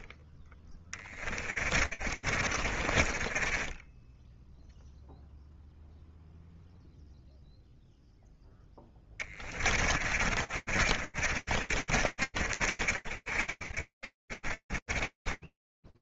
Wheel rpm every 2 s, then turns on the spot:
20, 30, 0, 0, 20, 50, 40, 40.
0-4 8-16